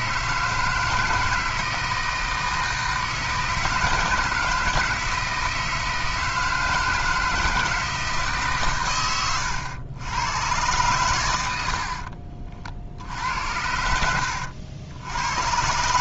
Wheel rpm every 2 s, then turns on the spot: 160, 160, 160, 160, 110, 110, 60, 80.
none